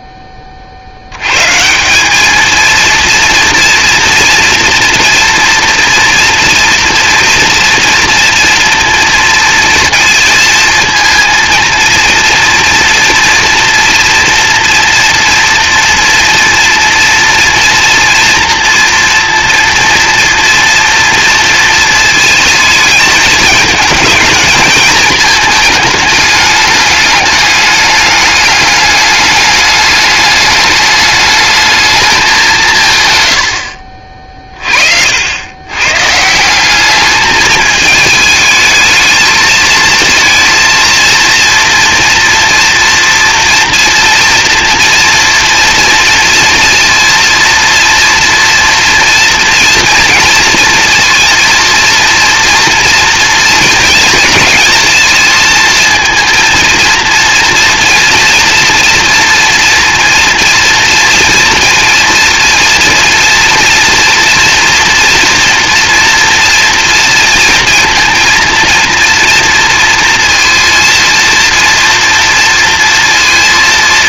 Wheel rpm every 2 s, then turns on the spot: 10, 210, 230, 230, 240, 230, 230, 230, 230, 230, 240, 230, 220, 210, 210, 210, 200, 50, 160, 220, 230, 230, 230, 230, 230, 230, 230, 220, 230, 230, 230, 230, 240, 230, 230, 230, 230.
34-36